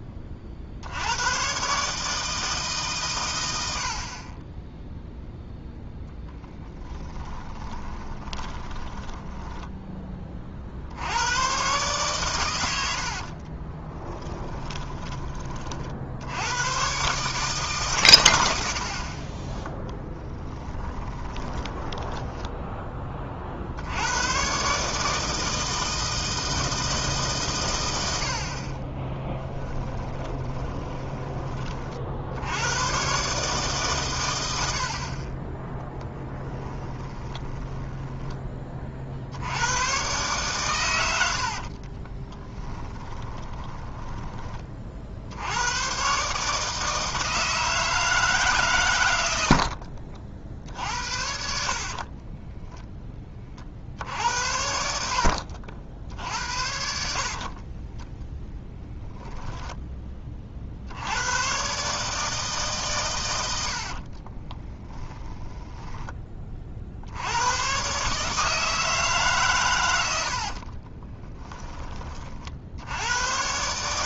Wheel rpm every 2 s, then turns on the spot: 60, 150, 10, 10, 20, 70, 80, 10, 110, 50, 20, 10, 140, 160, 40, 20, 100, 70, 10, 40, 100, 20, 30, 160, 120, 60, 20, 70, 60, 10, 60, 140, 20, 60, 160, 40, 70.
4-10 14-16 20-22 28-32 36-38 42-44 52-58 64-66 70-72